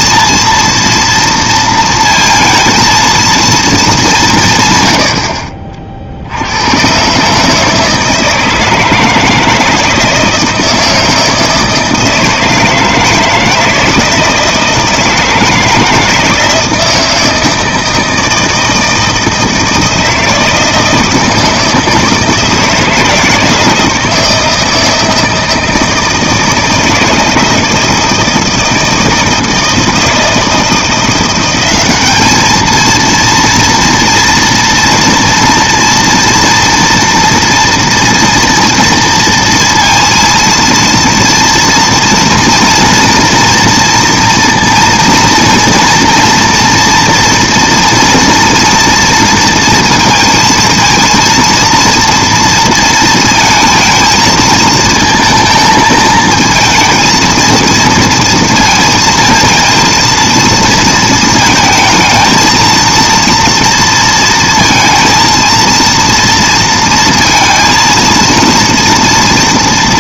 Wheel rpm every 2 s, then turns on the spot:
230, 230, 150, 90, 160, 160, 160, 160, 160, 160, 160, 160, 160, 160, 160, 160, 220, 230, 230, 230, 230, 230, 230, 230, 230, 230, 230, 230, 220, 230, 230, 220, 230, 230, 230.
none